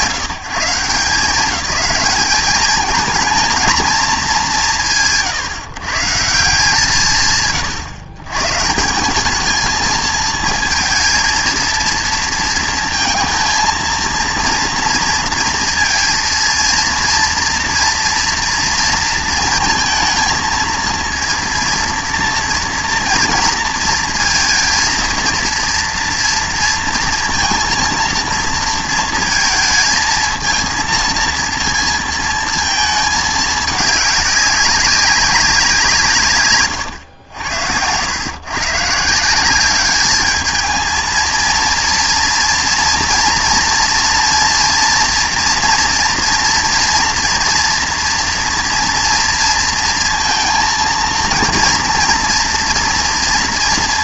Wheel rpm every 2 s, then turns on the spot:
170, 210, 210, 150, 130, 220, 230, 230, 230, 230, 230, 230, 230, 230, 230, 230, 230, 200, 140, 120, 220, 230, 230, 230, 230, 230, 230.
none